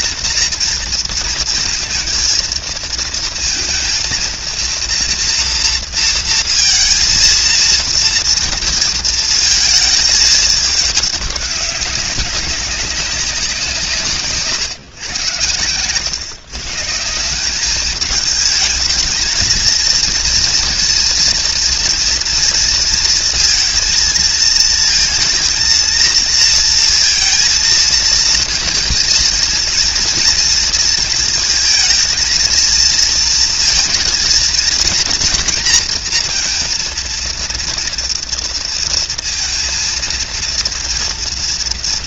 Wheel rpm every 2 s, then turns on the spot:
230, 230, 230, 230, 230, 210, 190, 140, 150, 220, 230, 230, 230, 230, 230, 230, 230, 230, 230, 230, 240.
none